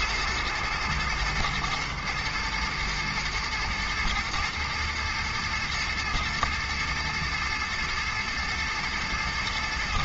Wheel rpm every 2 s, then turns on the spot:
120, 120, 110, 110, 110.
none